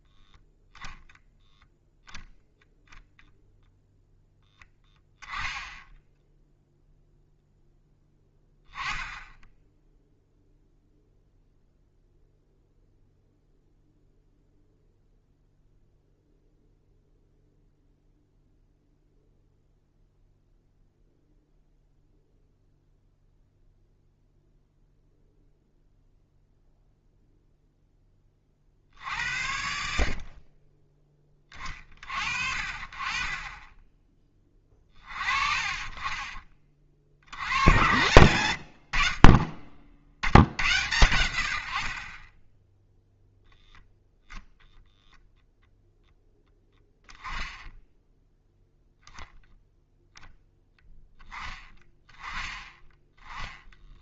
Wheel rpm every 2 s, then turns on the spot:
0, 0, 10, 0, 10, 0, 0, 0, 0, 0, 0, 0, 0, 0, 50, 20, 40, 20, 30, 70, 100, 0, 0, 0, 0, 0, 10.
none